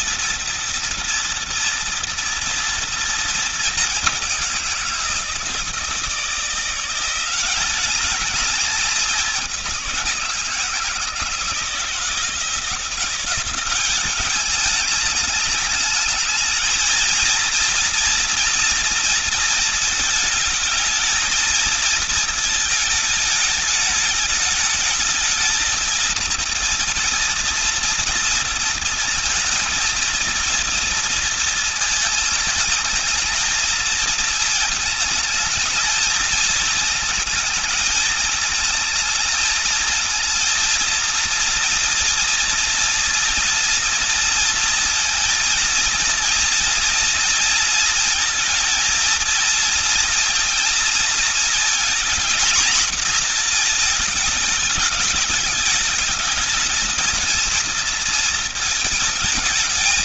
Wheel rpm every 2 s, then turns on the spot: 230, 230, 180, 170, 210, 170, 170, 210, 220, 230, 220, 220, 210, 230, 230, 230, 210, 220, 220, 220, 230, 230, 230, 230, 230, 230, 240, 220, 220, 220.
none